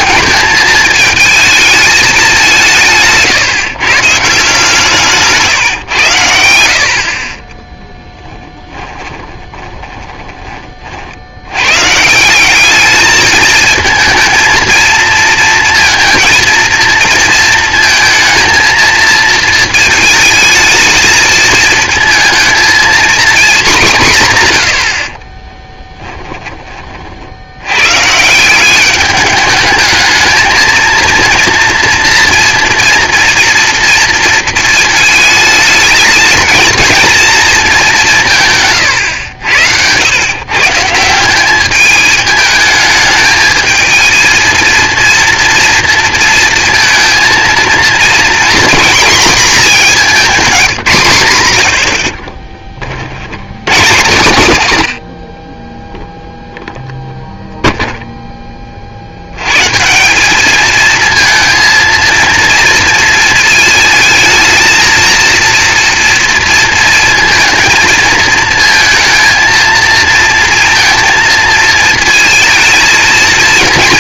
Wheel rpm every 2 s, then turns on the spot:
220, 170, 160, 80, 20, 30, 190, 230, 230, 220, 220, 230, 120, 20, 180, 220, 240, 230, 220, 140, 140, 210, 220, 230, 230, 180, 40, 120, 0, 20, 210, 230, 220, 230, 220, 230, 220.
8-10 38-40 50-54